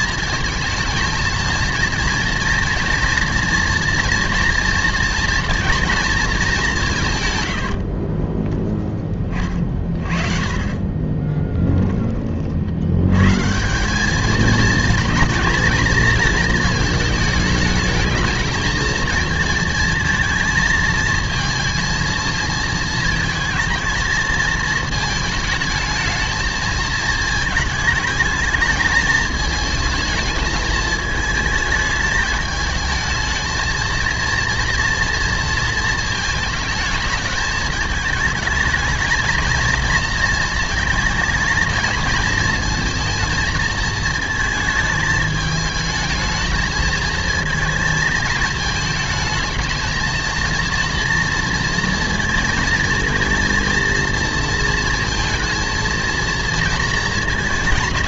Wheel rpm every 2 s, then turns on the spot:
220, 230, 230, 200, 10, 40, 50, 220, 220, 220, 230, 220, 220, 220, 220, 220, 220, 230, 220, 220, 230, 220, 220, 220, 220, 230, 230, 230, 230.
10-12